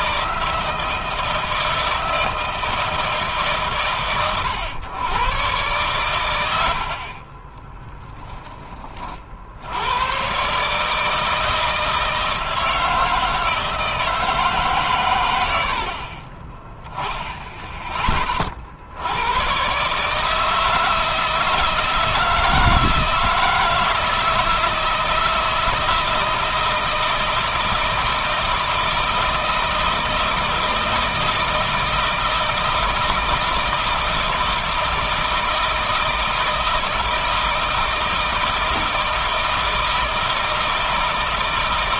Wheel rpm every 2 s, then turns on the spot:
160, 160, 110, 80, 20, 130, 160, 150, 20, 40, 160, 160, 160, 160, 160, 160, 160, 160, 160, 160, 160.
6-8